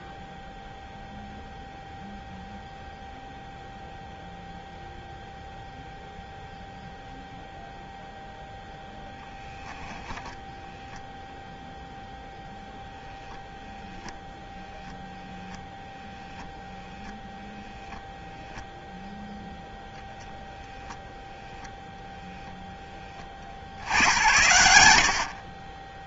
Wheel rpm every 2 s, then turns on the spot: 0, 0, 0, 0, 0, 0, 0, 0, 0, 0, 0, 10, 150.
none